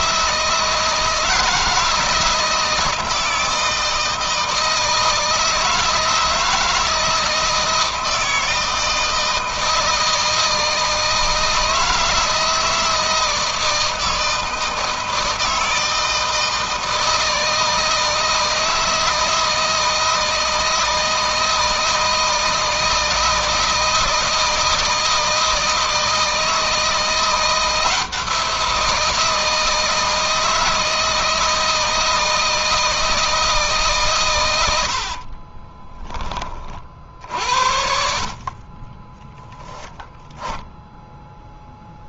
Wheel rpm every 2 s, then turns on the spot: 160, 160, 160, 160, 160, 160, 160, 160, 160, 160, 160, 160, 160, 160, 170, 160, 160, 80, 50, 40, 10.
34-36 38-40